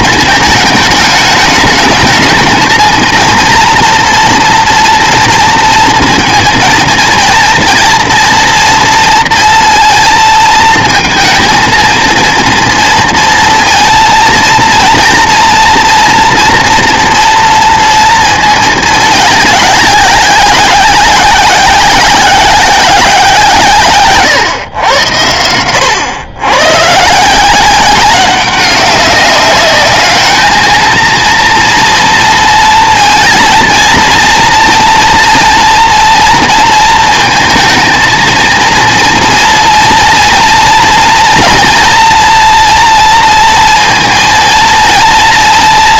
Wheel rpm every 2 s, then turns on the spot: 220, 220, 230, 230, 230, 220, 230, 230, 230, 220, 190, 190, 110, 120, 190, 220, 230, 230, 230, 230, 230, 230, 230.
none